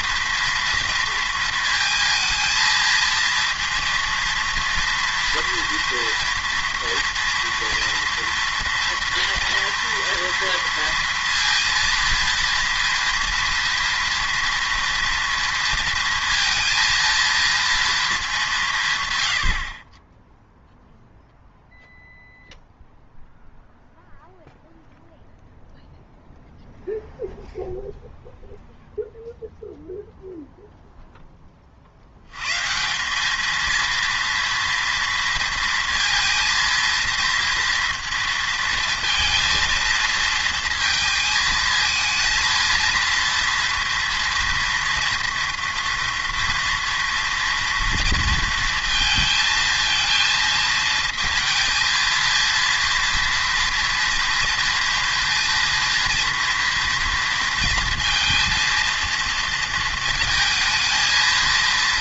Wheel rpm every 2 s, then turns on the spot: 230, 230, 230, 230, 230, 230, 230, 230, 230, 170, 0, 0, 0, 0, 0, 0, 150, 230, 230, 230, 220, 230, 230, 230, 230, 220, 230, 230, 230, 230, 220.
none